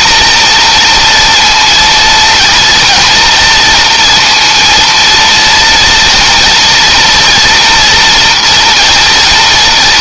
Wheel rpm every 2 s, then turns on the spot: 240, 230, 230, 230, 230.
none